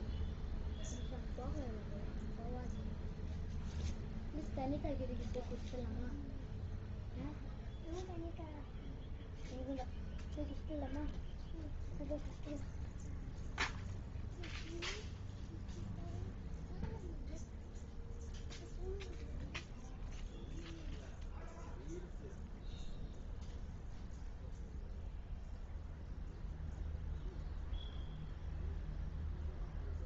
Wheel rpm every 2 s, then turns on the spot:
0, 0, 0, 0, 0, 0, 0, 0, 0, 0, 0, 0, 0, 0, 0.
none